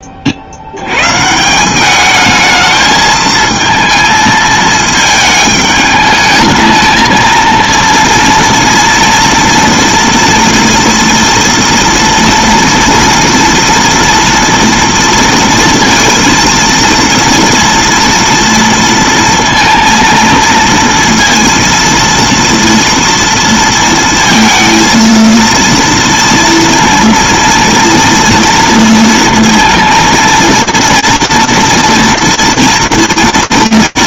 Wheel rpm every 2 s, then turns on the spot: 50, 210, 220, 210, 230, 230, 230, 230, 230, 230, 230, 230, 230, 230, 230, 230, 230.
none